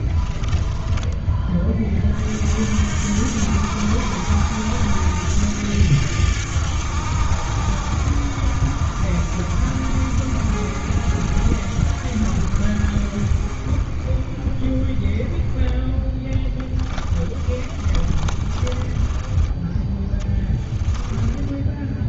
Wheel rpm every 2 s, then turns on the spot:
10, 60, 70, 70, 60, 60, 50, 20, 20, 20, 10.
0-2 16-22